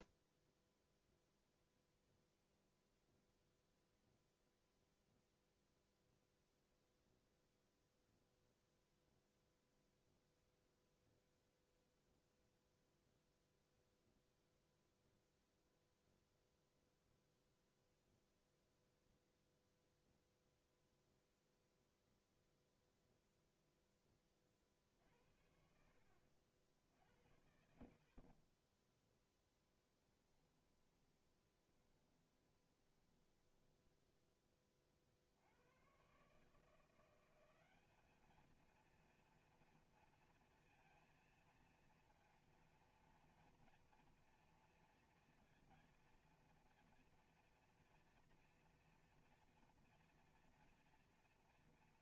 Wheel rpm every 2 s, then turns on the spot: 0, 0, 0, 0, 0, 0, 0, 0, 0, 0, 0, 0, 60, 60, 0, 20, 20, 50, 180, 230, 230, 230, 230, 230, 230, 230.
30-34